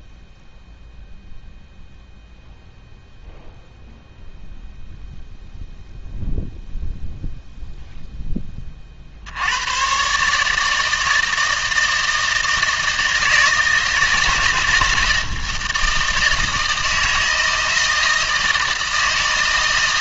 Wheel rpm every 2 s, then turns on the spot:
0, 0, 0, 0, 30, 160, 160, 160, 160, 160.
none